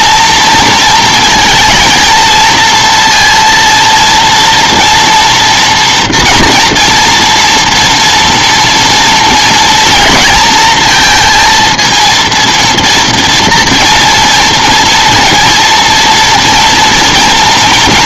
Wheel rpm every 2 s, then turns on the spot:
230, 230, 230, 240, 230, 230, 230, 230, 230.
none